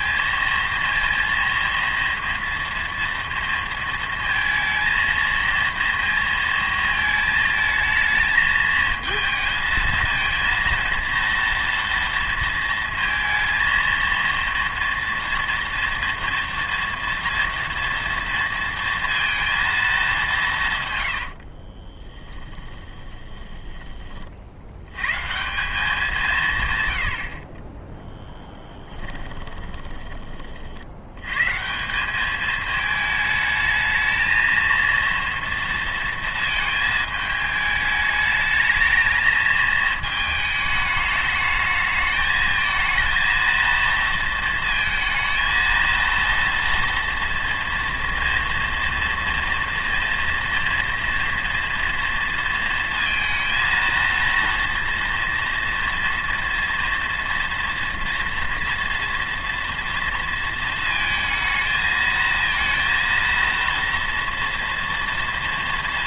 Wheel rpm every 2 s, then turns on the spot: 230, 230, 230, 220, 220, 230, 230, 230, 230, 230, 150, 10, 90, 120, 20, 50, 220, 230, 220, 220, 220, 220, 230, 230, 230, 230, 230, 230, 230, 230, 230, 230, 230.
22-24 28-30